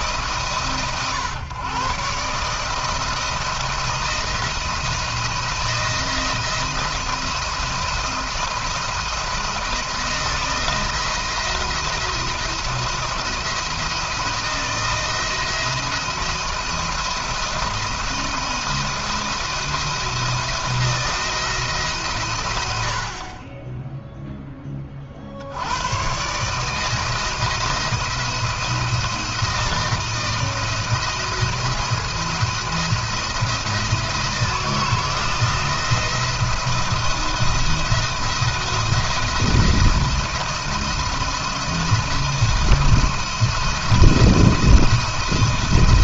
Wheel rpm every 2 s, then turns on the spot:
140, 150, 170, 160, 170, 160, 170, 170, 170, 170, 170, 80, 20, 150, 170, 170, 170, 160, 170, 170, 170, 170, 170.
none